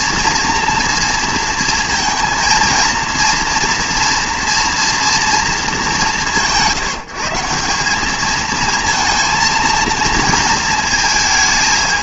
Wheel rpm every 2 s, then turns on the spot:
230, 230, 230, 140, 220, 230.
none